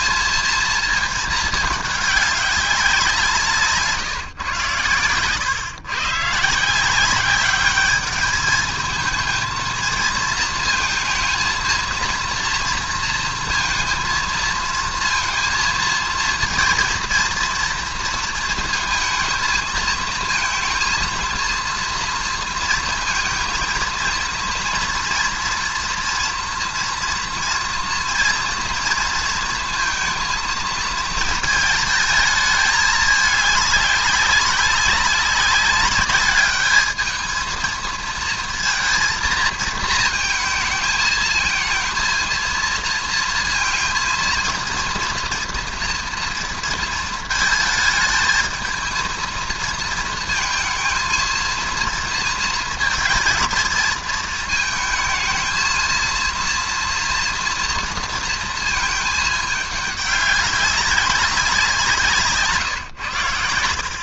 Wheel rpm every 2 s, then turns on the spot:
220, 200, 120, 150, 220, 230, 230, 220, 230, 230, 230, 230, 230, 230, 230, 220, 220, 190, 210, 230, 220, 230, 230, 230, 220, 230, 230, 230, 230, 230, 200, 140.
none